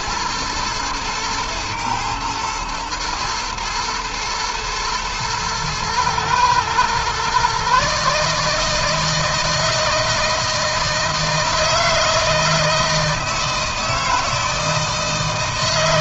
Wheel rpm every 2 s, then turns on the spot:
110, 110, 110, 120, 160, 160, 160, 160.
none